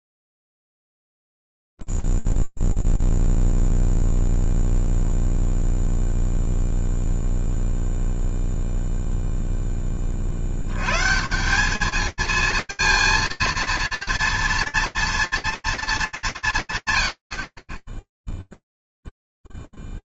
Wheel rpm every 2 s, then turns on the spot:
0, 0, 0, 0, 0, 80, 220, 230, 150, 0.
none